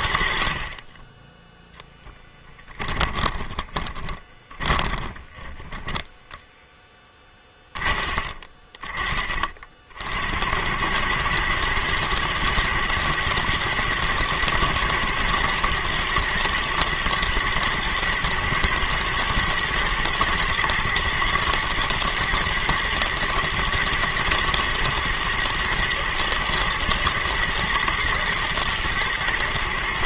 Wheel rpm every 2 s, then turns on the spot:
40, 20, 20, 10, 30, 100, 110, 110, 120, 120, 110, 120, 110, 120, 120.
2-8